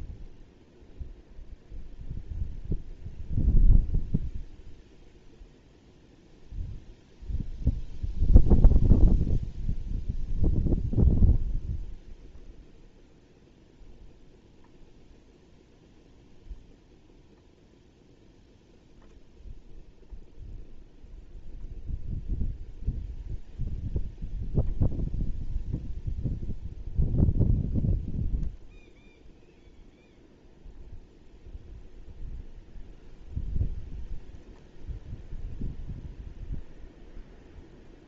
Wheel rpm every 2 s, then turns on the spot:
0, 0, 0, 0, 0, 0, 0, 0, 0, 0, 0, 0, 0, 0, 0, 0, 0, 0, 0.
none